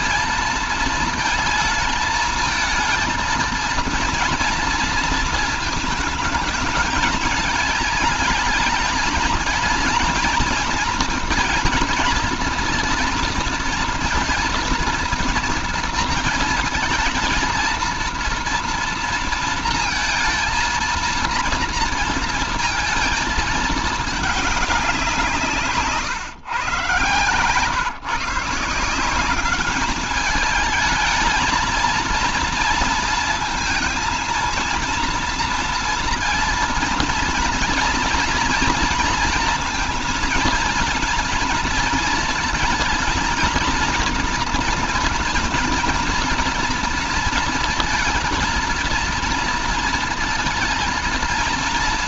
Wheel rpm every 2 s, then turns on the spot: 230, 220, 230, 220, 210, 220, 230, 230, 230, 230, 230, 230, 210, 130, 150, 210, 230, 230, 230, 230, 230, 230, 230, 230, 230, 230.
none